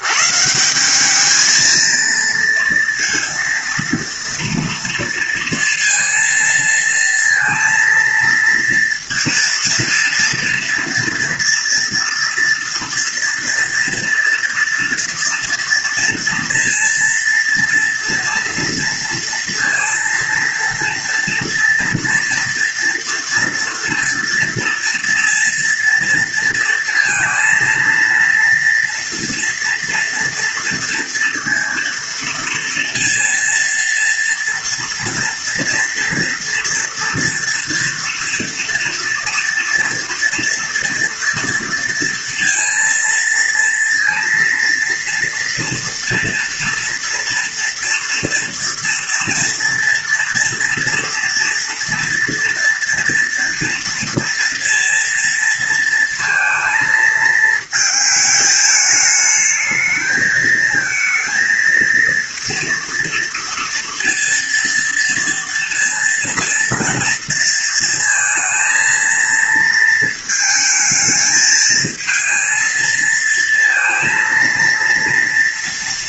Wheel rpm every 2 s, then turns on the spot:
190, 230, 230, 230, 230, 230, 230, 230, 230, 230, 230, 230, 230, 230, 230, 230, 230, 230, 230, 230, 230, 230, 230, 240, 230, 230, 230, 240, 220, 210, 230, 230, 230, 230, 230, 220, 230, 230.
none